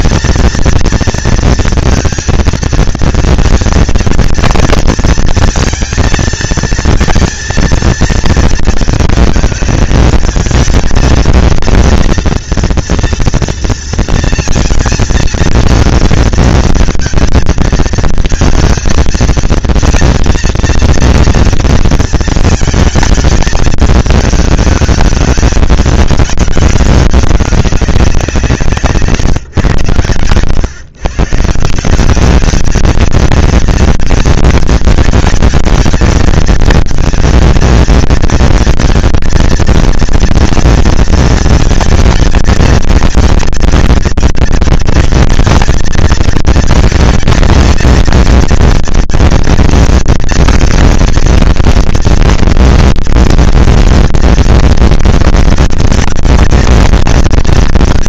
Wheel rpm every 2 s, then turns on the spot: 230, 230, 230, 230, 230, 220, 230, 230, 230, 230, 230, 220, 210, 210, 180, 120, 200, 220, 220, 230, 240, 230, 230, 220, 230, 230, 230, 230, 220.
none